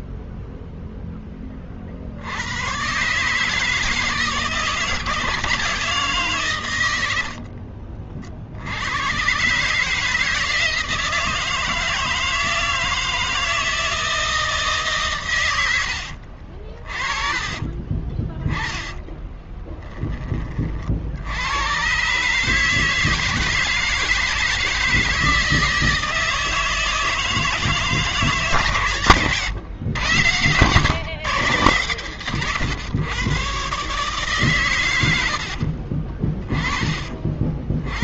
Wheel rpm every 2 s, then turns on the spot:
0, 130, 170, 130, 70, 170, 160, 160, 50, 10, 20, 150, 160, 160, 130, 120, 120, 120, 30.
none